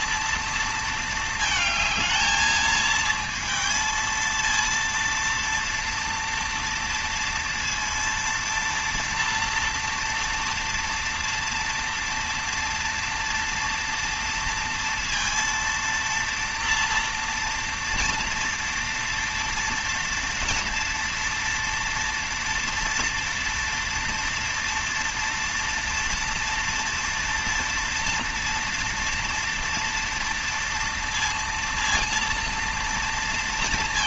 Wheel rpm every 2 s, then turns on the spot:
230, 220, 230, 230, 230, 230, 230, 230, 230, 230, 240, 230, 230, 230, 230, 230, 230.
none